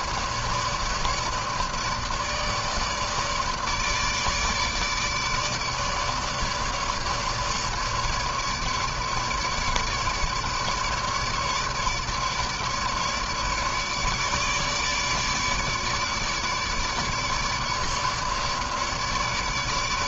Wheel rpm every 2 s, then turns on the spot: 150, 150, 150, 150, 150, 150, 150, 150, 150, 150.
none